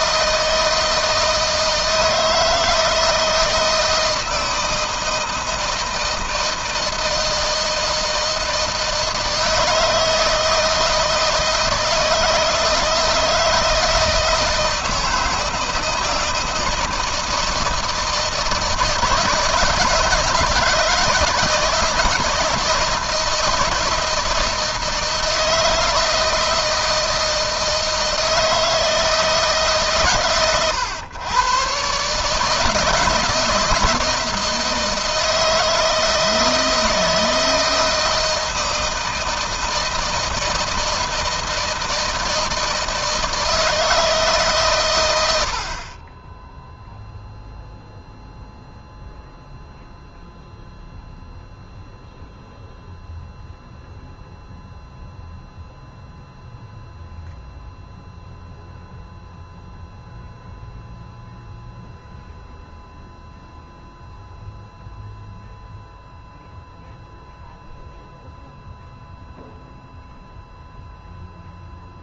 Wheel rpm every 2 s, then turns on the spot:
160, 160, 160, 160, 160, 160, 160, 160, 160, 160, 160, 170, 160, 160, 160, 110, 160, 160, 160, 160, 160, 160, 100, 0, 0, 0, 0, 0, 0, 0, 0, 0, 0, 0, 0, 0.
none